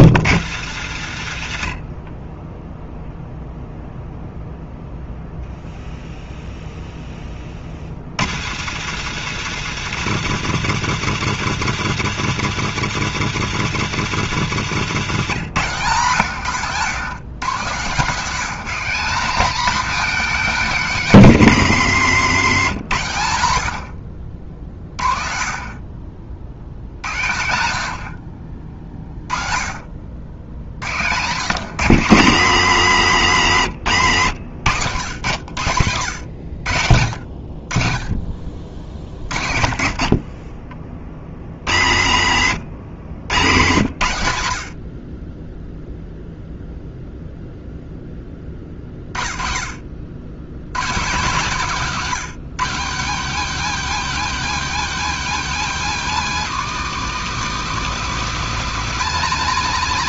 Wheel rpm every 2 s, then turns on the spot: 100, 0, 0, 10, 130, 150, 150, 140, 120, 200, 220, 130, 50, 60, 30, 80, 130, 100, 80, 50, 30, 90, 60, 0, 30, 140, 200, 260, 240, 240.
14-16 42-44